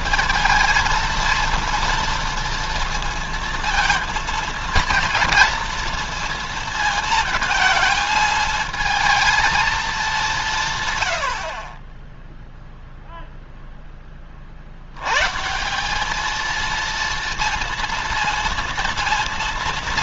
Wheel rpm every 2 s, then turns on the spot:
230, 230, 230, 230, 220, 140, 0, 80, 230, 230.
none